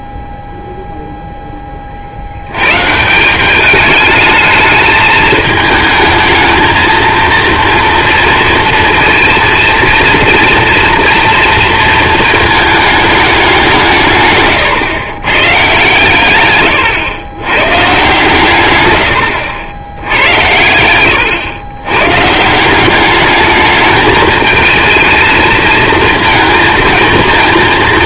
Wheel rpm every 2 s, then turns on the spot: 0, 90, 220, 220, 230, 230, 220, 130, 130, 130, 100, 160, 220, 220.
14-16